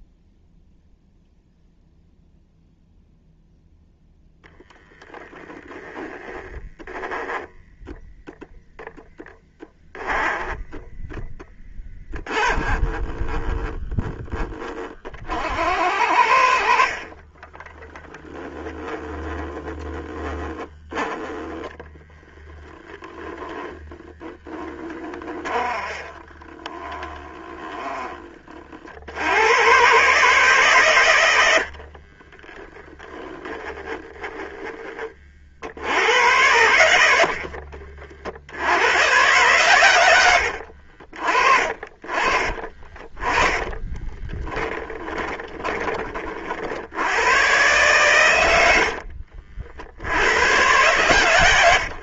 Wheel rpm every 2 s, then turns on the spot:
0, 0, 0, 10, 0, 10, 20, 20, 40, 10, 10, 0, 10, 30, 70, 120, 10, 20, 90, 90, 60, 30, 20, 70, 80, 120.
18-20 24-28 32-34 36-38 40-46 48-50